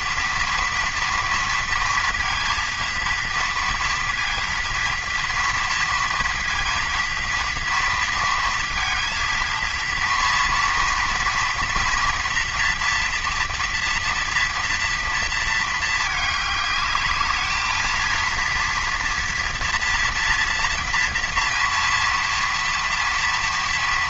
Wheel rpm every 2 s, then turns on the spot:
240, 230, 230, 230, 230, 240, 230, 230, 210, 230, 230, 230.
none